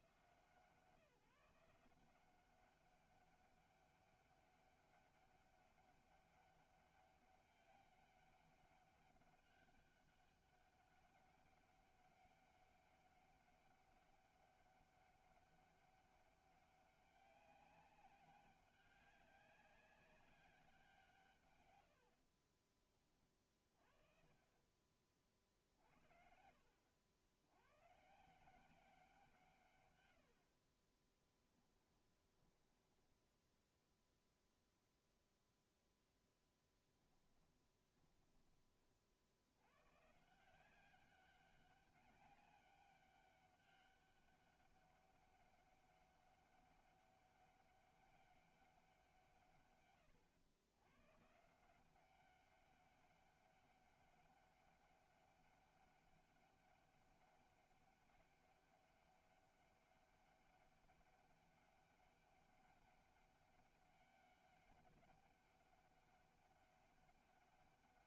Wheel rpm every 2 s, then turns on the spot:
160, 190, 200, 200, 200, 190, 200, 200, 200, 200, 190, 30, 30, 70, 180, 40, 10, 0, 10, 20, 180, 200, 200, 200, 190, 110, 200, 200, 200, 200, 200, 200, 200, 200.
22-24 30-34 36-38